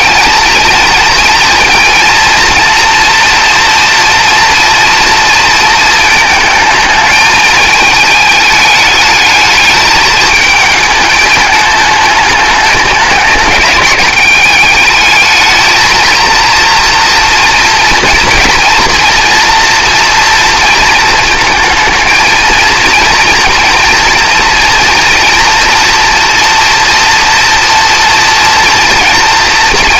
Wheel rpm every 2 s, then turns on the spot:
230, 230, 230, 220, 210, 210, 210, 200, 230, 240, 230, 230, 230, 230, 230.
none